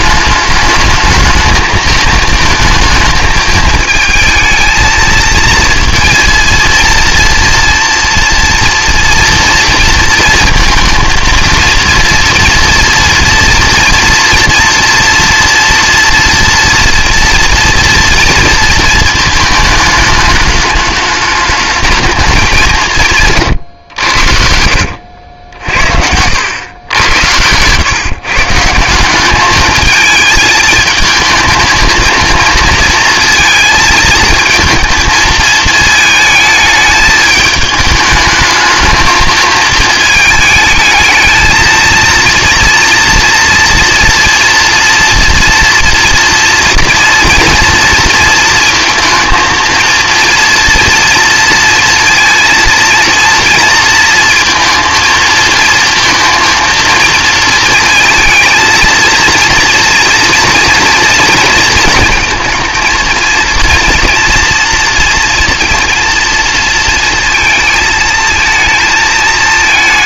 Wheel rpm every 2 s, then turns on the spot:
210, 220, 220, 230, 230, 230, 230, 230, 240, 230, 210, 190, 80, 90, 160, 220, 230, 230, 220, 220, 220, 240, 230, 230, 220, 230, 230, 230, 230, 230, 230, 220, 230, 230, 220.
24-26